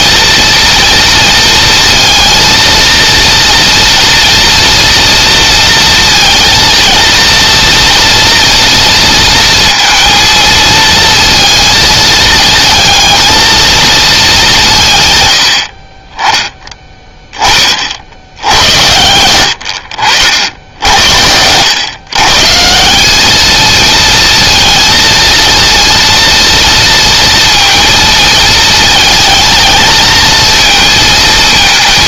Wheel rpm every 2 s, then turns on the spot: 230, 230, 230, 230, 230, 230, 220, 170, 20, 90, 70, 170, 230, 230, 220, 220.
18-20